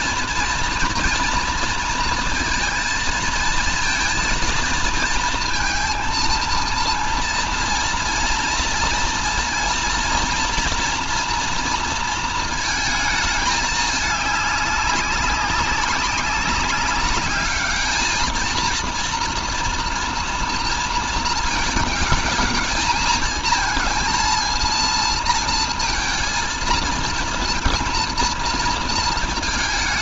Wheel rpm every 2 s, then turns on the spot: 230, 230, 230, 230, 230, 230, 220, 200, 190, 230, 230, 220, 230, 230, 230.
none